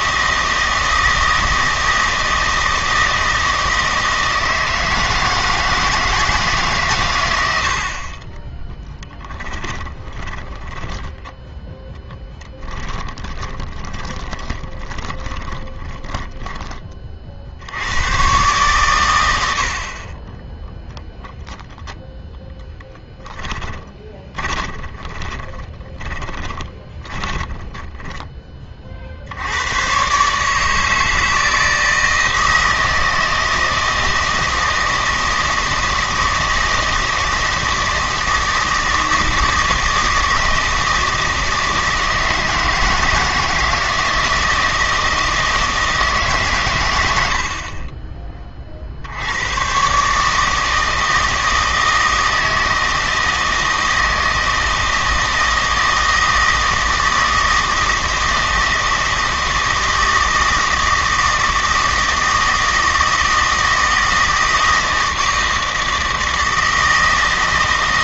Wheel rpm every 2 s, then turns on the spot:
160, 160, 160, 140, 10, 10, 10, 20, 20, 120, 0, 0, 20, 20, 30, 150, 160, 160, 160, 160, 160, 160, 160, 120, 50, 160, 160, 160, 160, 160, 160, 160, 160, 160.
8-10 12-16 24-28